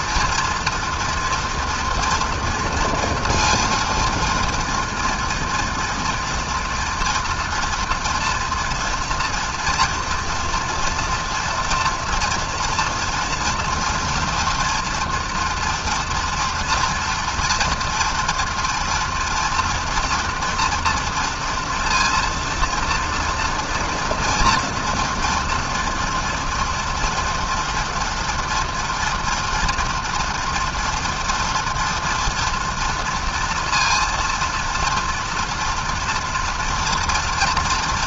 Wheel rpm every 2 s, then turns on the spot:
230, 230, 230, 230, 230, 230, 230, 230, 240, 230, 230, 230, 230, 230, 230, 230, 230, 230, 230.
none